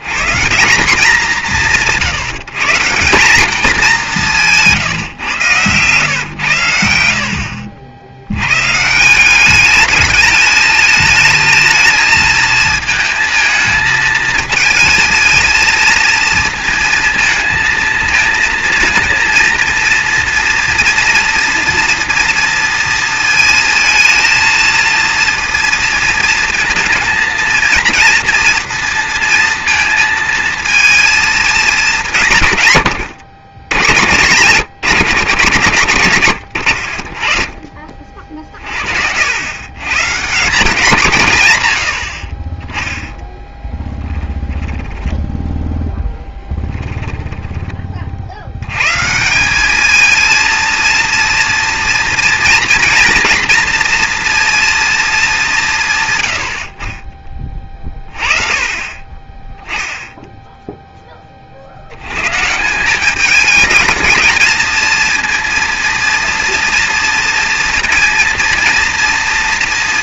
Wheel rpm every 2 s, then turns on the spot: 180, 160, 170, 100, 120, 220, 220, 220, 230, 230, 230, 230, 230, 230, 230, 230, 130, 110, 50, 50, 170, 30, 10, 10, 80, 230, 230, 230, 60, 30, 0, 140, 230, 230, 230.
4-6 44-48